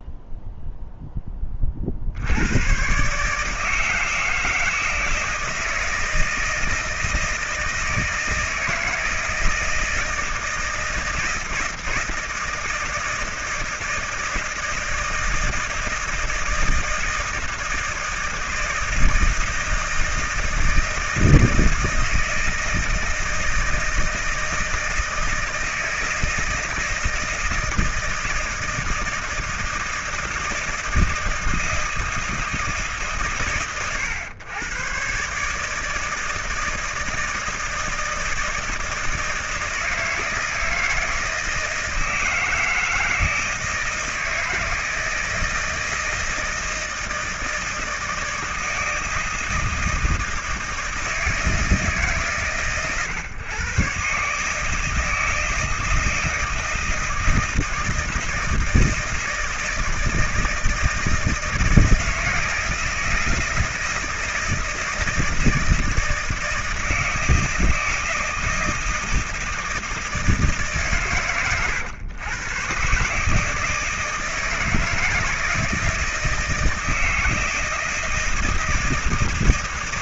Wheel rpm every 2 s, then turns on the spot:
0, 100, 160, 160, 160, 160, 160, 170, 160, 160, 160, 160, 170, 160, 160, 160, 160, 120, 160, 160, 160, 160, 160, 160, 160, 160, 140, 150, 160, 160, 160, 160, 160, 160, 160, 150, 130, 160, 160, 160.
none